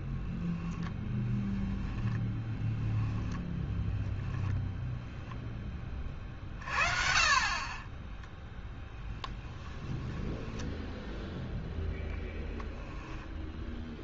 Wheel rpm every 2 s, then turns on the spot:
10, 10, 10, 40, 0, 10, 0.
0-4